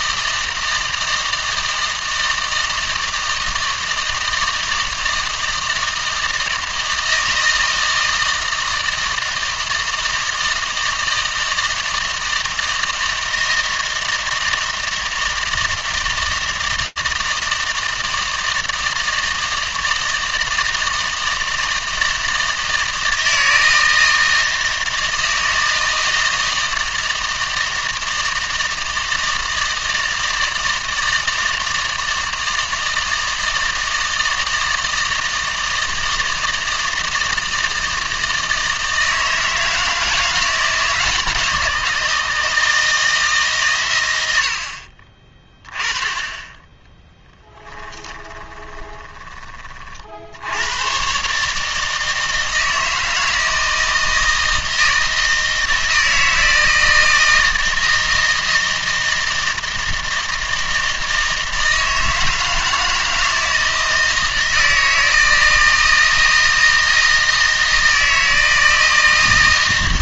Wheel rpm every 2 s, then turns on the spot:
160, 160, 160, 160, 160, 160, 160, 160, 160, 160, 160, 160, 160, 160, 160, 160, 160, 160, 160, 160, 160, 160, 60, 10, 20, 100, 160, 160, 160, 160, 160, 160, 160, 160, 160.
48-50